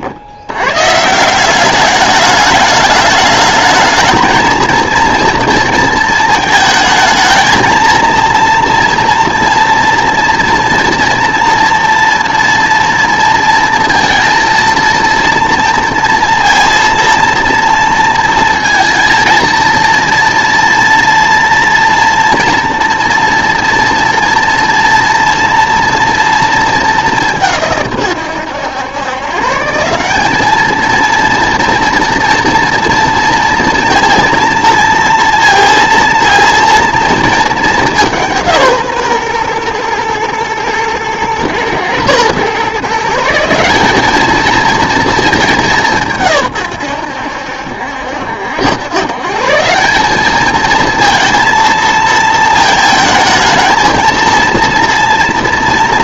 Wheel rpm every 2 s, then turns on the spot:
120, 210, 230, 220, 230, 230, 230, 230, 230, 230, 230, 230, 230, 210, 110, 220, 230, 230, 230, 150, 110, 140, 230, 110, 100, 220, 220, 230.
none